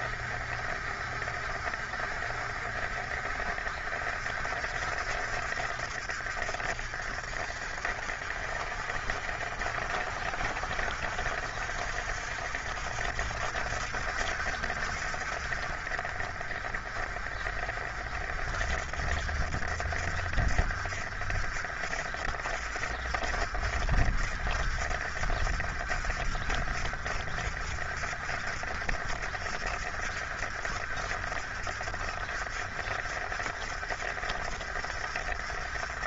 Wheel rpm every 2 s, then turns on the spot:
50, 50, 50, 50, 60, 60, 60, 50, 40, 50, 50, 50, 50, 50, 50, 50, 50, 50.
none